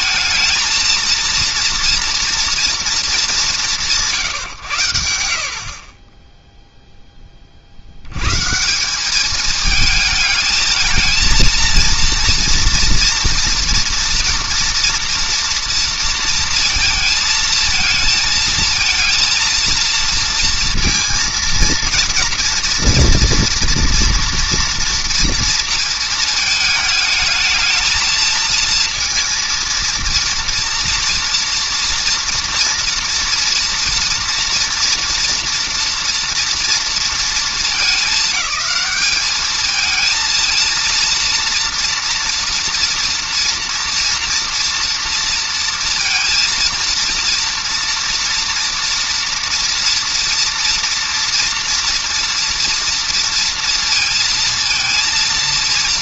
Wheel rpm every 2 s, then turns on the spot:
220, 240, 120, 0, 130, 220, 230, 240, 230, 230, 230, 230, 230, 220, 230, 230, 230, 230, 230, 200, 230, 230, 230, 230, 230, 230, 230, 230.
none